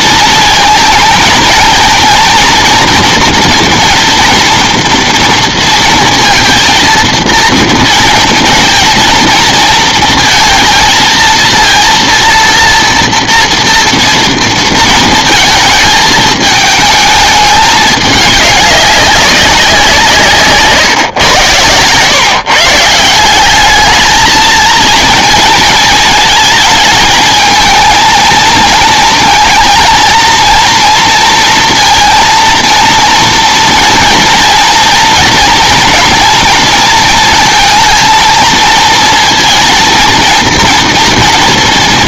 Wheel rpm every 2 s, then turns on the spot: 230, 230, 230, 230, 230, 230, 230, 230, 220, 200, 120, 150, 230, 220, 230, 230, 230, 230, 230, 220, 230.
none